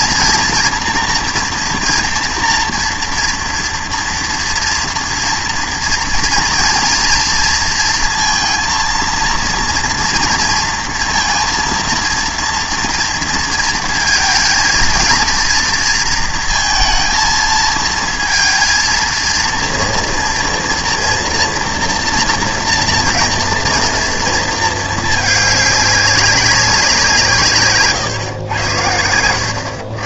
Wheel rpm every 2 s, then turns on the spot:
230, 230, 230, 230, 230, 230, 230, 230, 230, 230, 230, 230, 230, 190, 110.
none